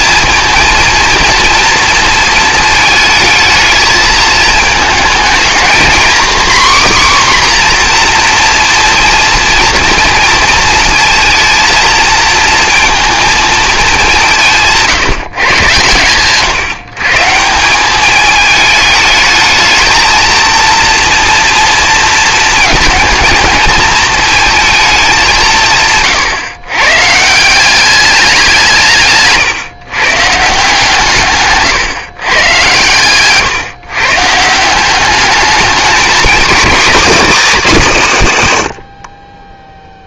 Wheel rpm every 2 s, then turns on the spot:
230, 220, 220, 270, 230, 230, 230, 160, 150, 220, 230, 220, 220, 130, 170, 160, 120, 170, 240, 110.
none